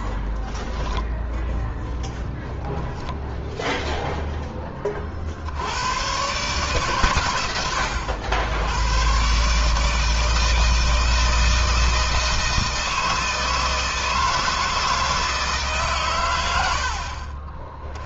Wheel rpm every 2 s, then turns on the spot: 10, 10, 20, 140, 100, 160, 160, 160, 70.
2-4